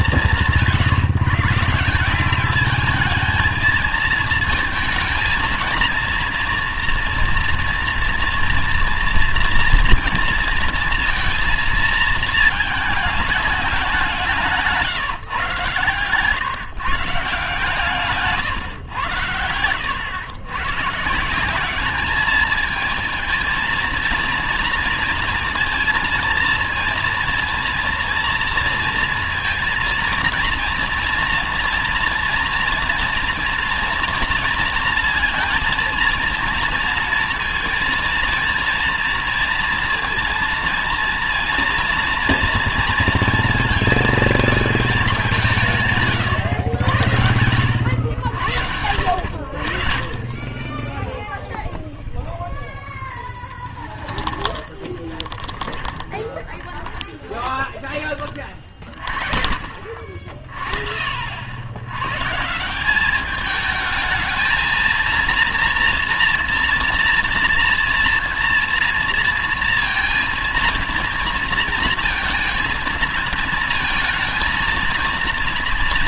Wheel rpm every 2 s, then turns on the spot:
170, 210, 230, 230, 230, 230, 220, 170, 130, 130, 120, 220, 230, 230, 230, 230, 230, 230, 230, 230, 230, 230, 220, 100, 90, 30, 0, 20, 20, 30, 40, 160, 220, 240, 230, 230, 230, 230.
54-58